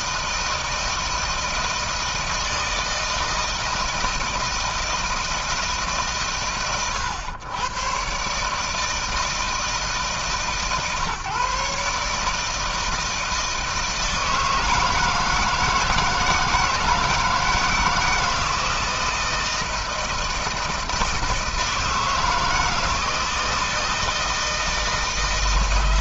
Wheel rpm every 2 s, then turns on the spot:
160, 160, 160, 130, 150, 140, 160, 160, 160, 160, 160, 160, 160.
none